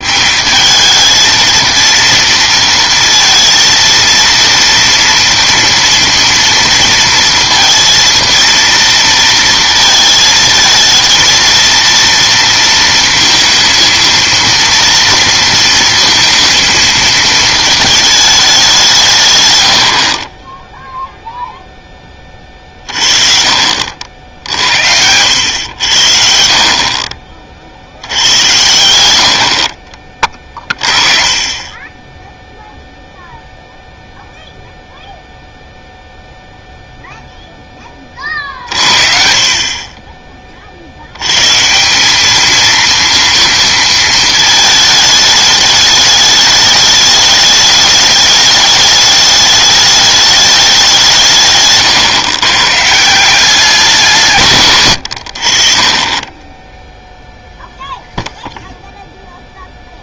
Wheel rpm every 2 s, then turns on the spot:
210, 230, 230, 230, 230, 220, 230, 230, 230, 180, 10, 30, 60, 40, 90, 30, 0, 0, 0, 50, 40, 220, 220, 210, 210, 200, 130, 120, 10, 0.
none